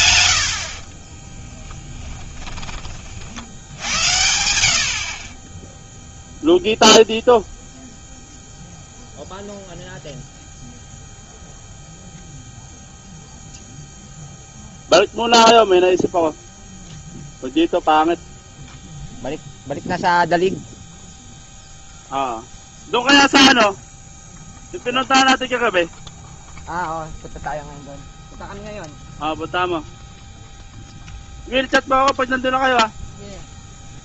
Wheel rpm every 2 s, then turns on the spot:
80, 10, 80, 0, 0, 0, 0, 0, 0, 0, 0, 0, 0, 0, 0, 0, 0.
none